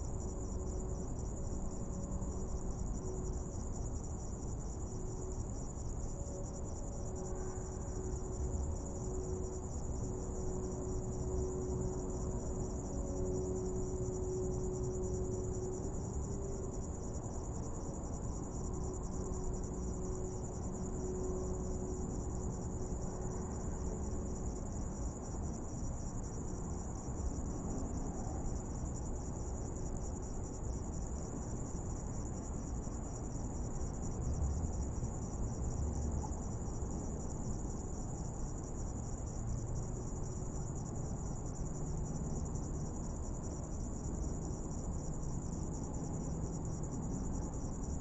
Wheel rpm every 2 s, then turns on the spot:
0, 0, 0, 0, 0, 0, 0, 0, 0, 0, 0, 0, 0, 0, 0, 0, 0, 0, 0, 0, 0, 0, 0, 0.
none